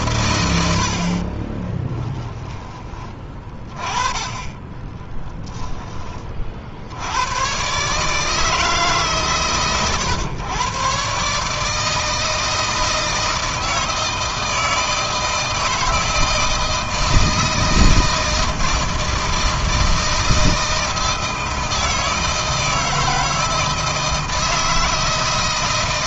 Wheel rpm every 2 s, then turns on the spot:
60, 20, 10, 80, 150, 130, 160, 160, 170, 160, 160, 160, 160.
0-2 4-6